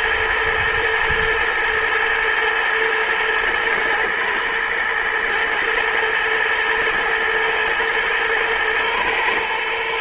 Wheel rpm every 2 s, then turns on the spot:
110, 110, 120, 110, 110.
none